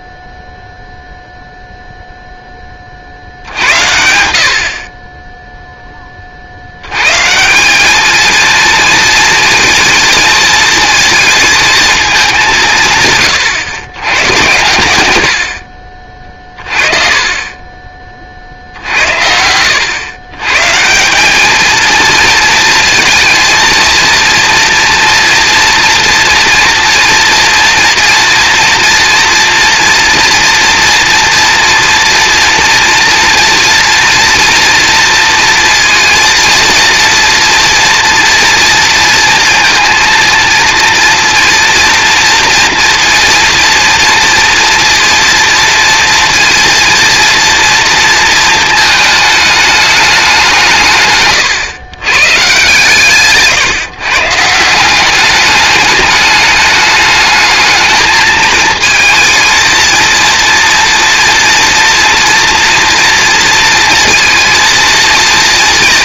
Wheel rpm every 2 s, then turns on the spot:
0, 0, 60, 70, 230, 220, 190, 120, 30, 70, 140, 230, 230, 230, 230, 230, 230, 230, 230, 230, 230, 230, 240, 230, 220, 150, 140, 170, 210, 220, 230, 230, 230.
none